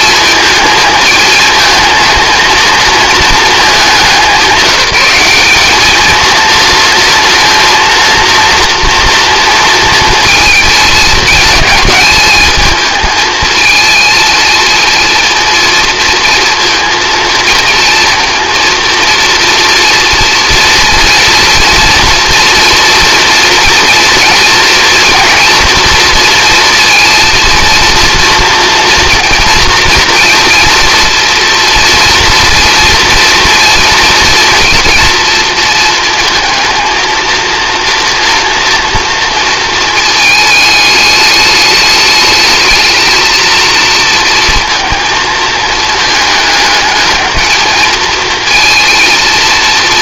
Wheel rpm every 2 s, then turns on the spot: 220, 230, 190, 230, 240, 220, 220, 230, 230, 230, 240, 230, 240, 230, 230, 230, 230, 230, 220, 230, 210, 220, 220, 220, 230.
none